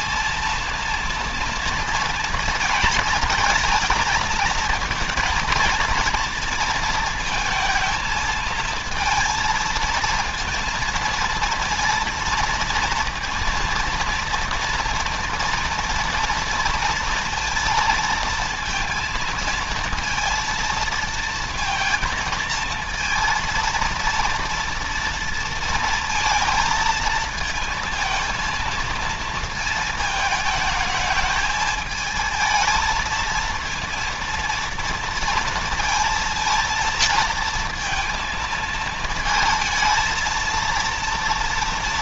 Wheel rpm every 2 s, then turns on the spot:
230, 220, 220, 230, 220, 230, 230, 240, 230, 230, 230, 230, 230, 220, 230, 220, 220, 230, 230, 220, 220.
none